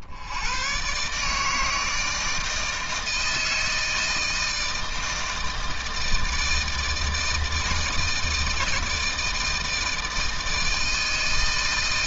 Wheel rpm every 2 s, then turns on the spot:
120, 160, 160, 160, 160, 160.
none